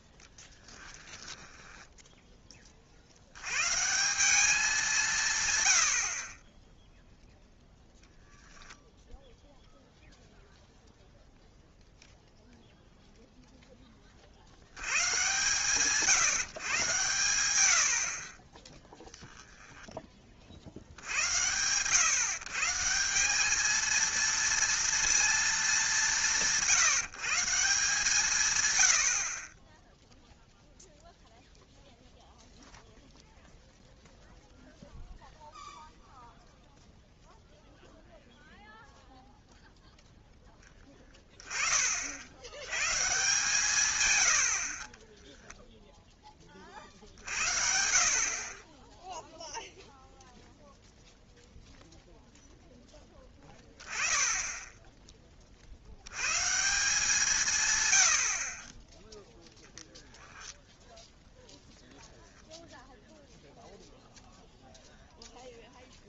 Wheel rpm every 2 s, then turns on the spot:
10, 30, 190, 10, 0, 0, 0, 90, 140, 20, 60, 150, 230, 170, 110, 0, 0, 0, 0, 0, 10, 100, 60, 30, 20, 0, 0, 10, 160, 30, 0, 0, 0.
0-2